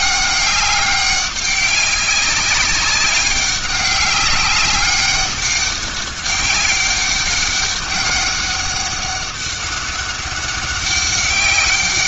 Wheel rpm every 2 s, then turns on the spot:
200, 190, 200, 200, 200, 200.
none